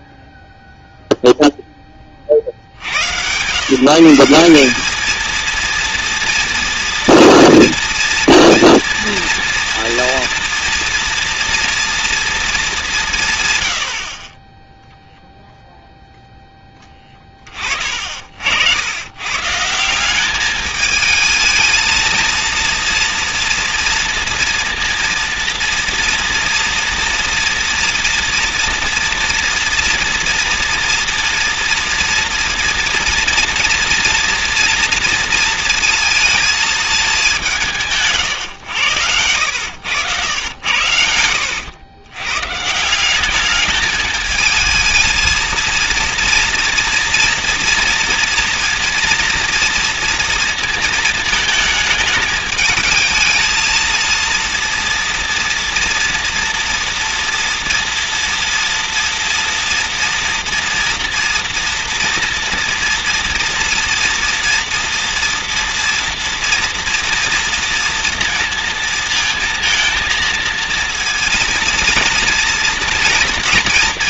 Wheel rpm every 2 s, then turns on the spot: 0, 70, 190, 230, 230, 230, 210, 10, 10, 80, 210, 230, 230, 230, 230, 240, 240, 230, 220, 130, 100, 130, 220, 240, 230, 230, 220, 230, 230, 230, 230, 240, 230, 230, 230, 230, 230.
16-18 38-40